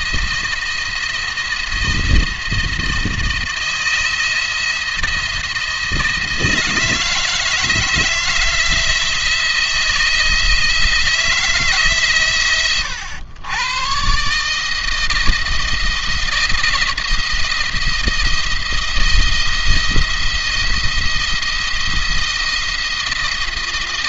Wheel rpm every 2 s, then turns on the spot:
170, 160, 170, 160, 160, 160, 110, 160, 170, 170, 170, 170.
none